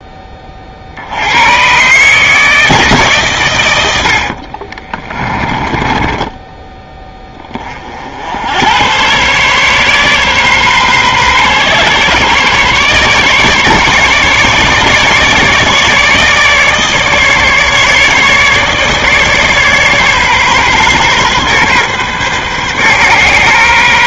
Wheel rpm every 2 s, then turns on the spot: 40, 150, 40, 10, 90, 130, 140, 150, 150, 150, 140, 130.
4-8